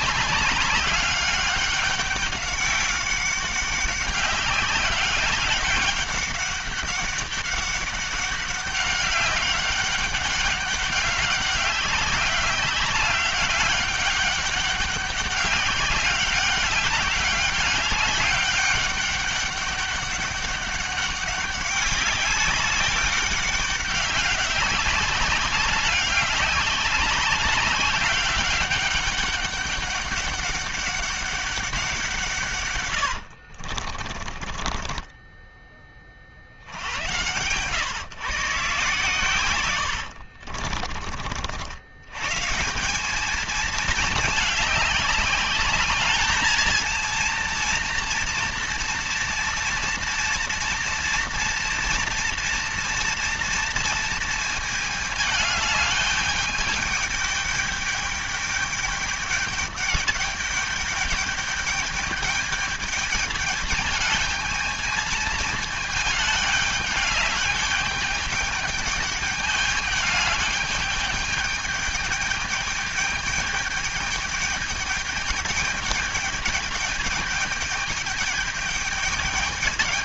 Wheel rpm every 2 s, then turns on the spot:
200, 200, 190, 200, 200, 200, 190, 200, 200, 200, 200, 200, 190, 200, 190, 200, 130, 20, 70, 150, 60, 150, 210, 220, 230, 230, 230, 220, 210, 210, 210, 210, 220, 210, 210, 210, 210, 210, 210, 210.
34-36 40-42